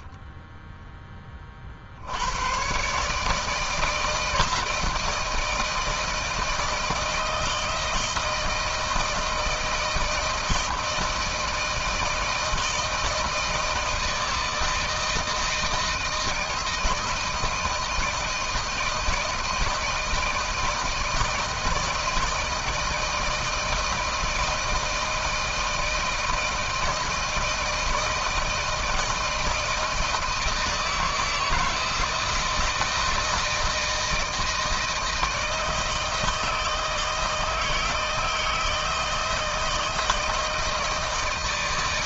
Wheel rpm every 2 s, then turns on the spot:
10, 120, 160, 160, 160, 160, 160, 160, 160, 170, 160, 160, 160, 160, 160, 160, 160, 160, 160, 160, 160.
none